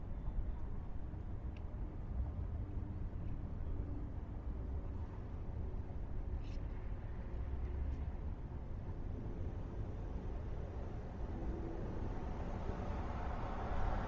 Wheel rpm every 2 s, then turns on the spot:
0, 0, 0, 0, 0, 0, 0.
none